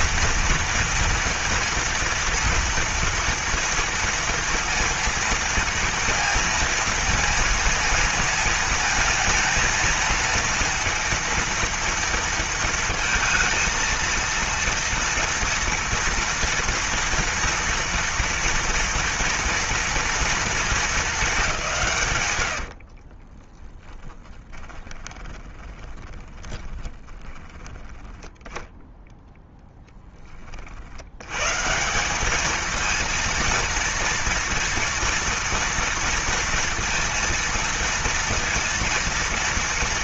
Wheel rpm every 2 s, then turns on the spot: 230, 230, 230, 230, 220, 230, 230, 230, 230, 230, 220, 50, 20, 20, 10, 70, 220, 230, 230, 230.
22-28